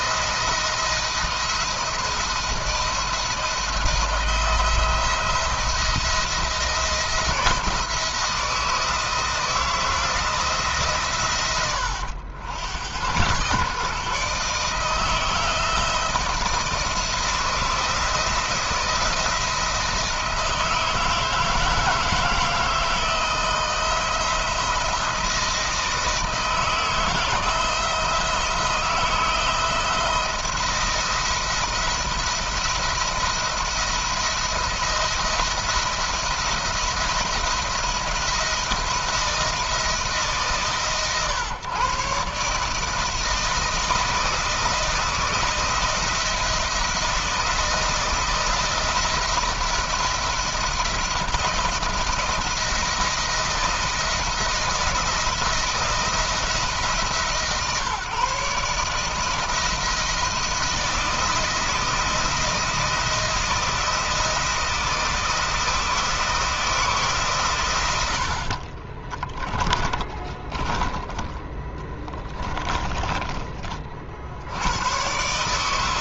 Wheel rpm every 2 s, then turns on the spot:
170, 170, 170, 160, 160, 150, 90, 150, 160, 170, 160, 160, 160, 160, 170, 170, 170, 170, 170, 170, 140, 150, 160, 170, 170, 170, 170, 160, 160, 150, 170, 170, 160, 160, 30, 20, 20, 100.
68-70 72-74